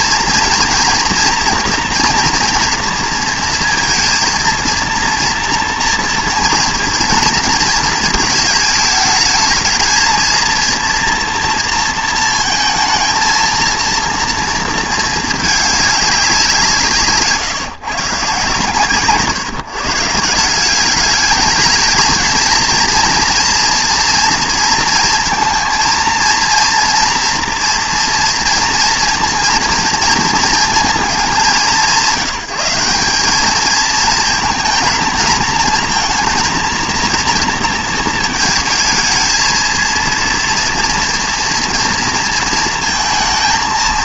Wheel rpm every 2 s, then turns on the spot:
240, 230, 230, 230, 220, 230, 230, 230, 180, 130, 170, 230, 230, 230, 230, 230, 180, 230, 230, 220, 230, 230.
none